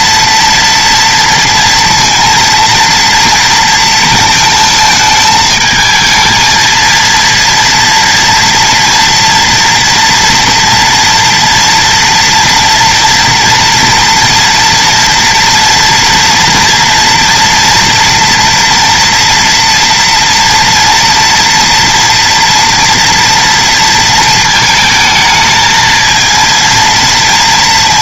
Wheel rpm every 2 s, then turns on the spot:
230, 230, 220, 230, 230, 230, 230, 230, 230, 230, 240, 230, 220, 230.
none